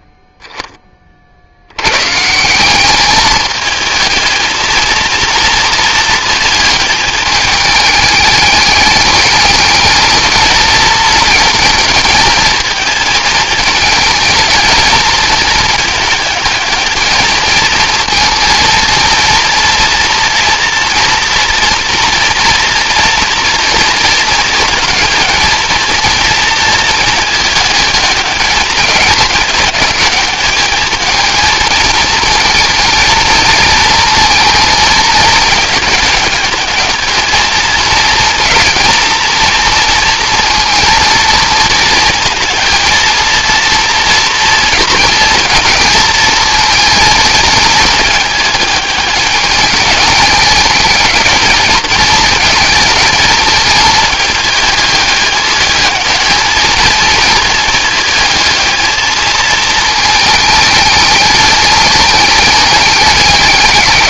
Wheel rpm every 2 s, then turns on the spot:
30, 180, 230, 220, 210, 220, 220, 220, 220, 230, 230, 230, 220, 230, 210, 210, 230, 220, 220, 230, 230, 230, 230, 230, 210, 210, 220, 210, 220, 220, 220, 210.
none